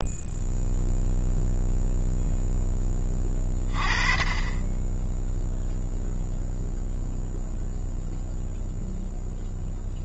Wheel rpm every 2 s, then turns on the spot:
0, 10, 10, 0, 0.
none